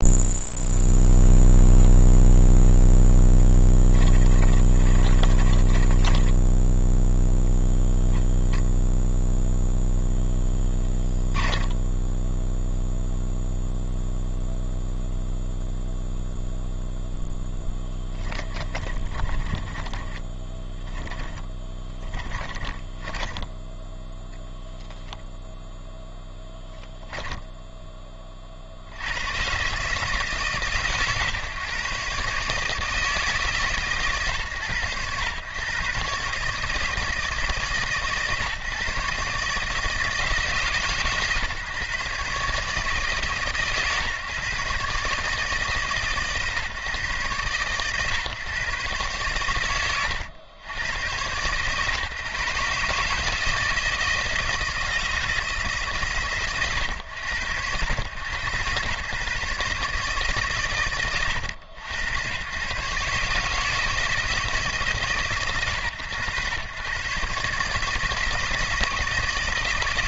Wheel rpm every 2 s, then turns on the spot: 0, 0, 30, 0, 0, 10, 0, 0, 0, 20, 20, 20, 0, 10, 50, 140, 150, 110, 150, 140, 150, 150, 140, 130, 120, 100, 140, 170, 110, 120, 100, 130, 160, 120, 160.
4-6 10-12 18-24